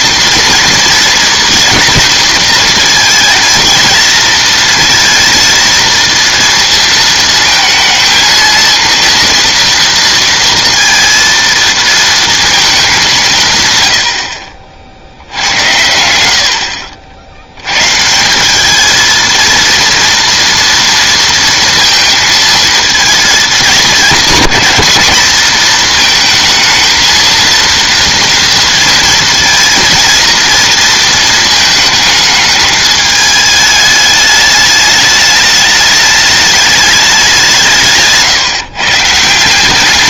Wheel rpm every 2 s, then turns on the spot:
230, 230, 230, 230, 230, 230, 220, 60, 60, 200, 230, 230, 210, 220, 230, 230, 220, 210, 210, 130.
none